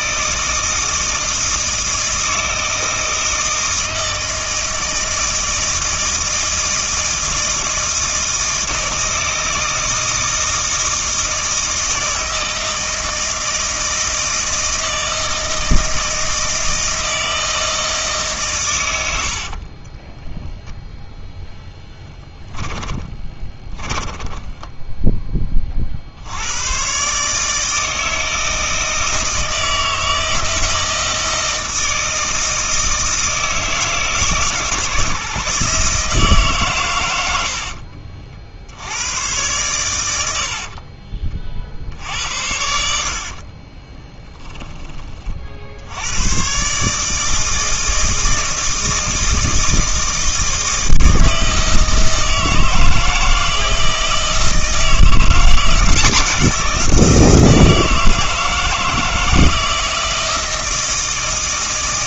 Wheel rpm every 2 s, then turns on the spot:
160, 160, 160, 160, 160, 160, 160, 160, 160, 110, 0, 10, 10, 120, 160, 160, 160, 150, 120, 90, 40, 60, 20, 140, 160, 160, 160, 170, 170, 160, 160.
18-20 22-24 40-42